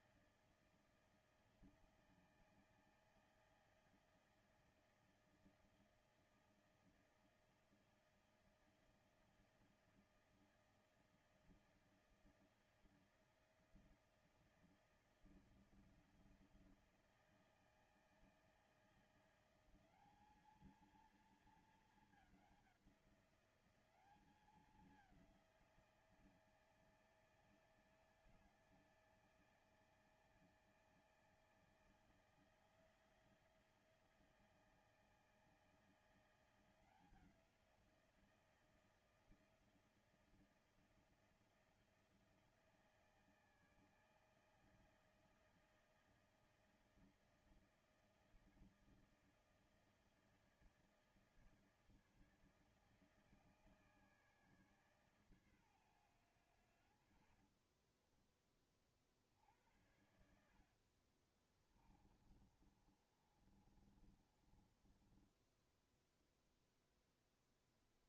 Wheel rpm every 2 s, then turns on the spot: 160, 160, 160, 160, 160, 160, 160, 160, 160, 160, 220, 190, 190, 160, 160, 160, 160, 160, 170, 170, 170, 160, 160, 160, 160, 160, 160, 140, 80, 40, 60, 30, 20, 0.
60-66